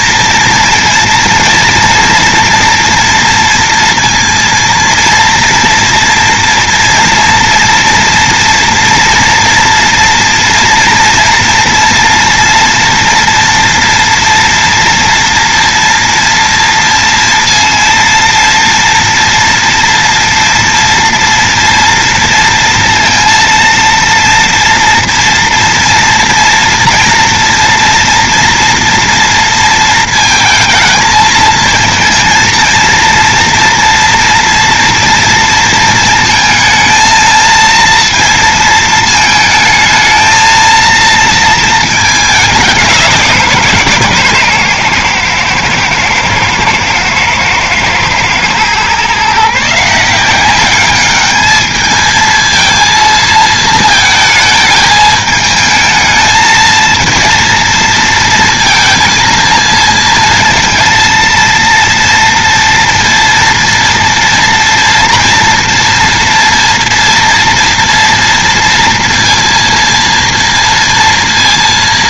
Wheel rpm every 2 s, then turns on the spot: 230, 230, 230, 230, 230, 240, 230, 230, 230, 230, 230, 230, 230, 230, 230, 220, 230, 230, 230, 230, 230, 200, 130, 120, 120, 190, 220, 220, 220, 230, 230, 230, 230, 230, 230, 230.
none